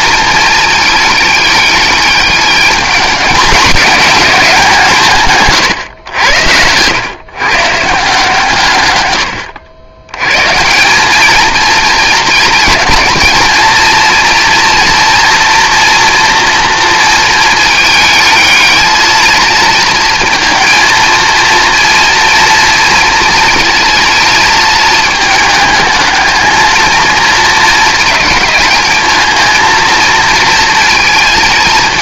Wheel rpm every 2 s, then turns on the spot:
220, 210, 160, 110, 130, 170, 220, 230, 230, 220, 230, 230, 220, 230, 220, 230.
none